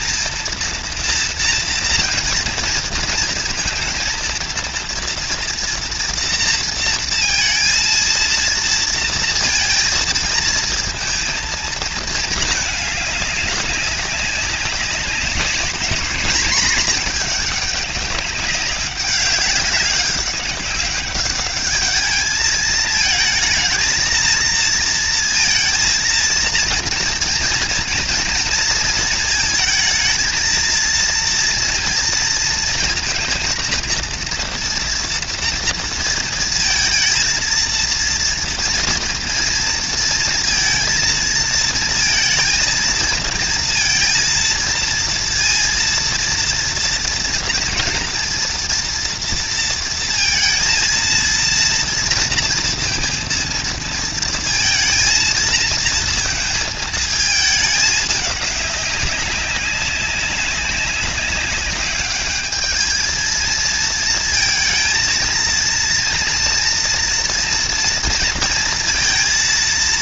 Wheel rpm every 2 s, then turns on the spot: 230, 230, 230, 230, 230, 210, 200, 220, 190, 200, 220, 230, 230, 220, 230, 230, 230, 220, 230, 230, 230, 230, 230, 240, 230, 230, 220, 220, 200, 200, 210, 230, 230, 230, 230.
none